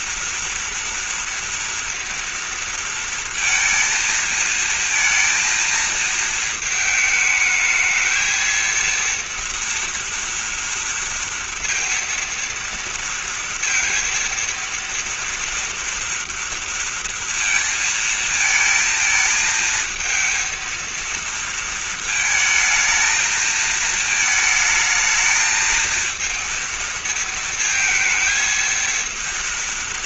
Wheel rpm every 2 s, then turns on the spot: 240, 230, 230, 220, 230, 230, 230, 230, 230, 220, 230, 220, 220, 220, 230.
none